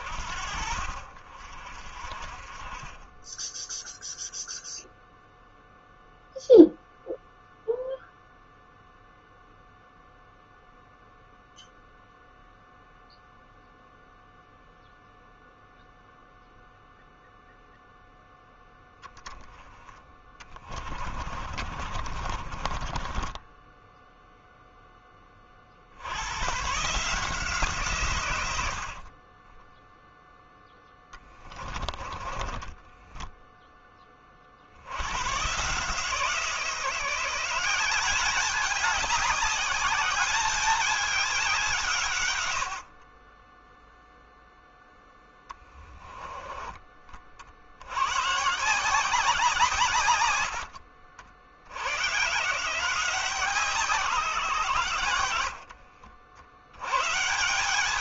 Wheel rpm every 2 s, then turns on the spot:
50, 20, 0, 0, 0, 0, 0, 0, 0, 0, 30, 20, 10, 140, 50, 10, 10, 90, 170, 200, 200, 40, 0, 30, 170, 70, 160, 110, 130.
20-24 30-34